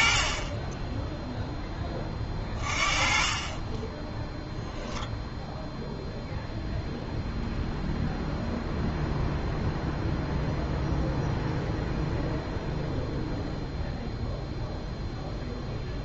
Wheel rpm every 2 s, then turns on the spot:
30, 30, 0, 0, 0, 0, 0, 0.
none